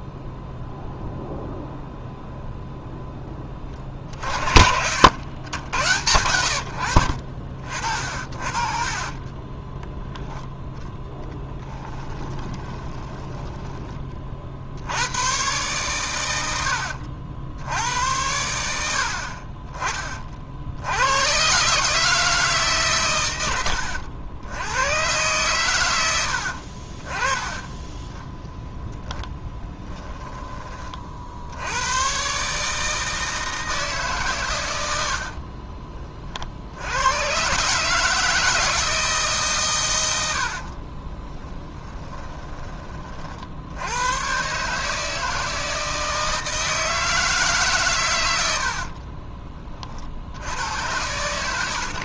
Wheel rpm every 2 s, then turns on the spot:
0, 0, 70, 80, 50, 10, 30, 60, 90, 100, 60, 150, 90, 60, 0, 20, 140, 110, 70, 160, 60, 20, 140, 160, 60, 90.
4-6 8-10 12-14 40-42 48-50